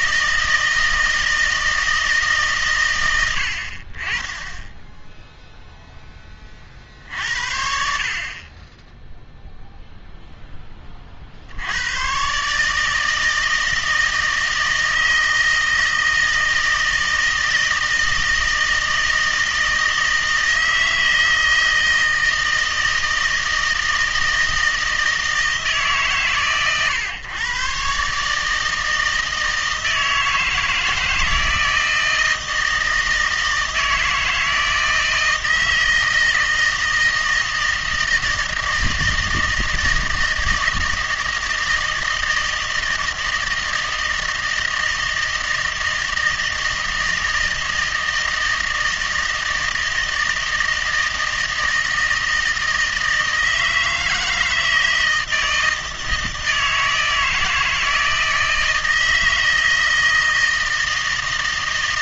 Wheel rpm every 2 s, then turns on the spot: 160, 120, 10, 40, 20, 30, 150, 160, 160, 160, 160, 160, 160, 120, 160, 160, 160, 160, 160, 160, 160, 160, 160, 160, 160, 160, 160, 160, 160, 160, 160.
none